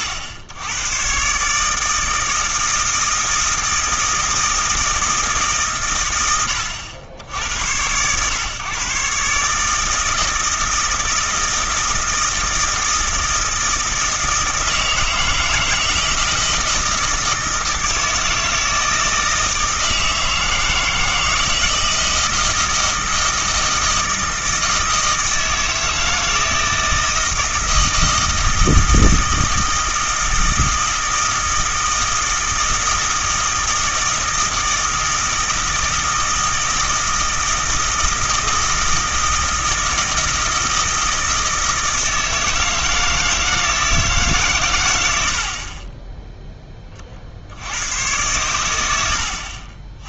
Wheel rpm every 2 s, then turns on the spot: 100, 160, 160, 90, 130, 160, 160, 160, 160, 160, 160, 160, 160, 160, 160, 160, 160, 160, 160, 160, 160, 160, 120, 20, 100.
none